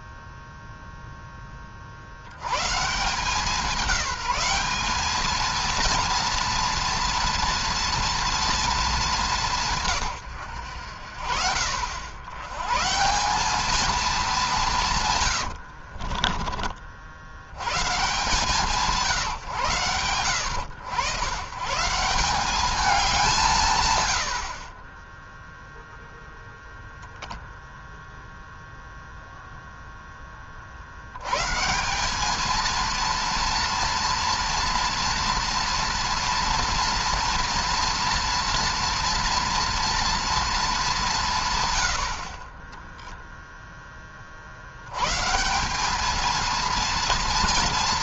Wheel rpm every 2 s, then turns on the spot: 0, 150, 210, 230, 220, 80, 150, 170, 70, 160, 110, 190, 20, 0, 0, 50, 230, 230, 240, 230, 200, 10, 100, 230.
14-16 42-44